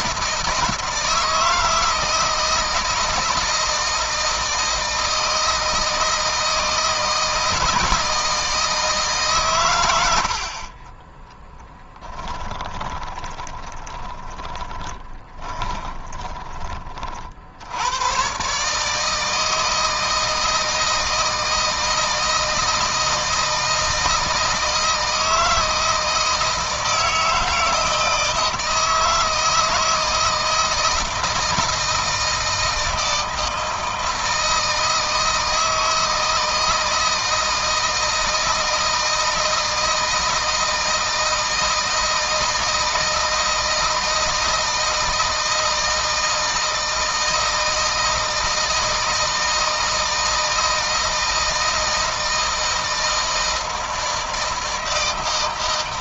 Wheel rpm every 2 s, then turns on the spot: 160, 160, 160, 160, 160, 20, 20, 10, 30, 150, 160, 160, 160, 160, 160, 160, 160, 160, 160, 160, 160, 160, 160, 160, 160, 160, 160, 160.
12-16